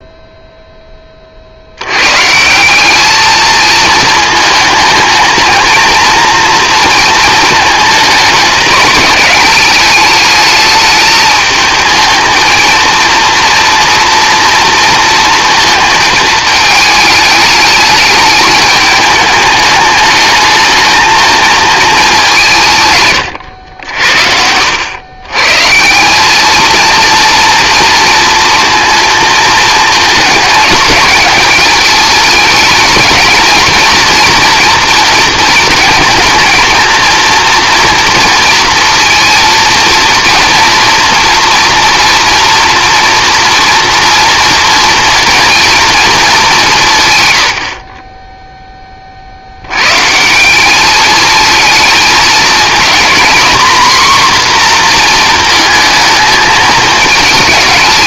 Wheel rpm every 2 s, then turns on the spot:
10, 190, 220, 230, 210, 210, 220, 230, 220, 210, 220, 180, 80, 220, 230, 220, 220, 230, 230, 230, 230, 230, 230, 190, 10, 190, 220, 250, 220.
none